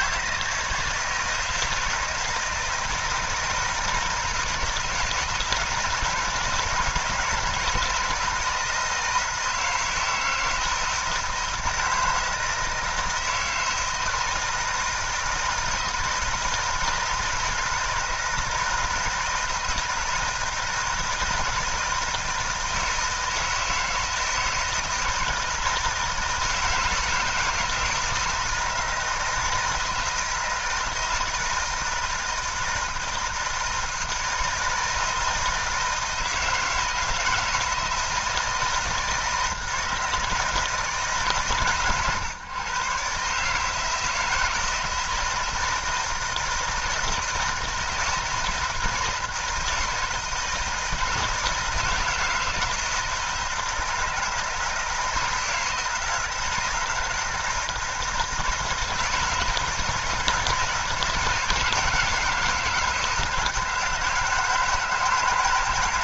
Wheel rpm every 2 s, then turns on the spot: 160, 160, 160, 160, 160, 160, 160, 160, 160, 160, 160, 160, 160, 160, 160, 160, 160, 160, 160, 160, 160, 130, 160, 170, 160, 160, 160, 160, 160, 160, 160, 170, 160.
none